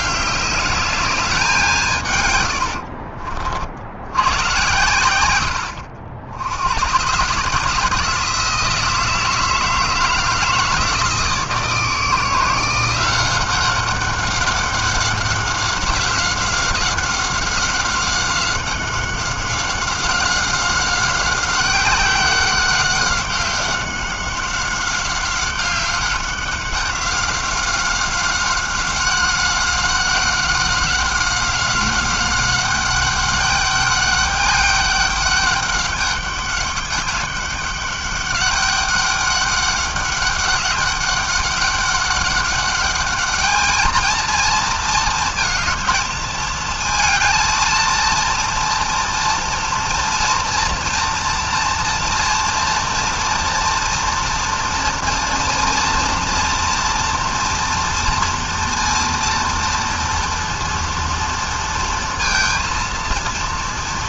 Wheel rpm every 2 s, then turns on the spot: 210, 110, 100, 90, 160, 160, 170, 190, 190, 190, 190, 190, 190, 190, 190, 190, 200, 200, 200, 200, 200, 200, 220, 220, 230, 230, 230, 230, 230, 230, 240, 230.
none